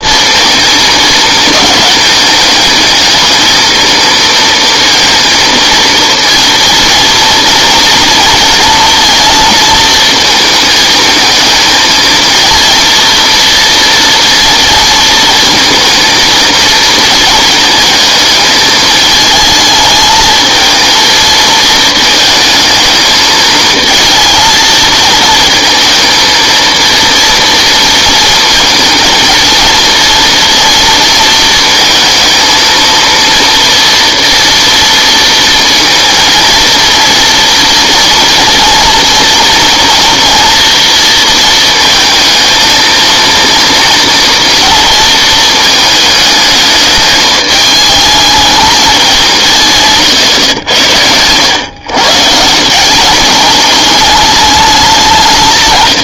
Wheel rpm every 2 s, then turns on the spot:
220, 220, 230, 230, 230, 220, 230, 230, 230, 220, 220, 220, 230, 230, 230, 230, 230, 230, 230, 230, 230, 230, 230, 210, 210, 100, 170, 200.
none